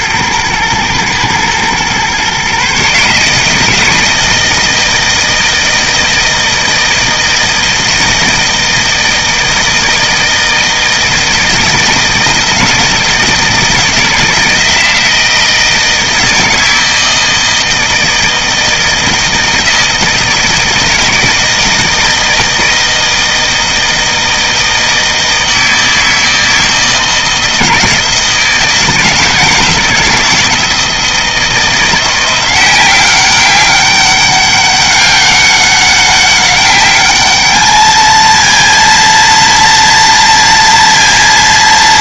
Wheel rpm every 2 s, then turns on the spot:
120, 140, 160, 160, 160, 160, 160, 160, 160, 160, 160, 160, 160, 160, 160, 160, 180, 200, 210, 230, 230.
none